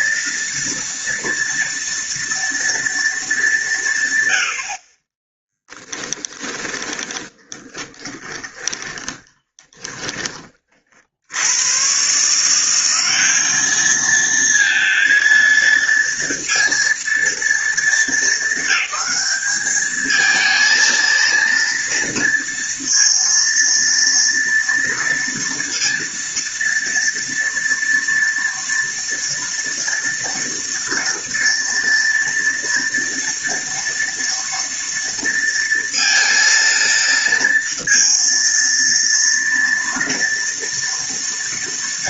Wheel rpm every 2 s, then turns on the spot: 230, 230, 80, 20, 20, 40, 160, 220, 230, 220, 220, 230, 230, 230, 240, 230, 230, 230, 230, 230, 230.
6-10